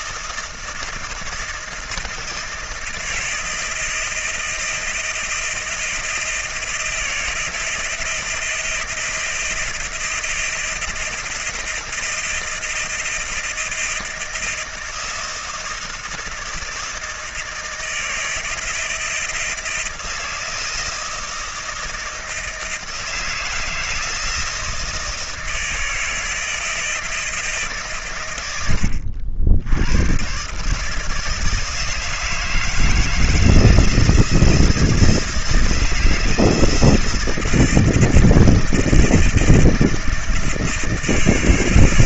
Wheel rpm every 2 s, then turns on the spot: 170, 170, 170, 170, 170, 160, 160, 170, 160, 160, 160, 160, 160, 160, 70, 160, 160, 170, 170, 160, 160.
none